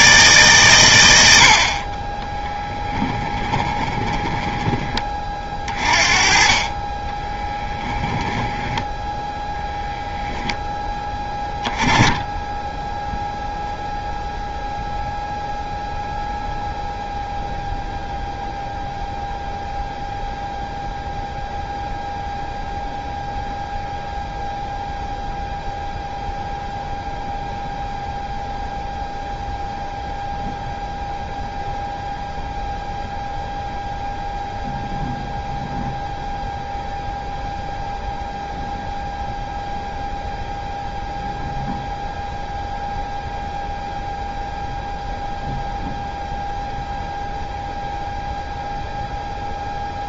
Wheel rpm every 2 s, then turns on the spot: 130, 10, 20, 30, 10, 10, 10, 0, 0, 0, 0, 0, 0, 0, 0, 0, 0, 0, 0, 0, 0, 0, 0, 0, 0.
2-10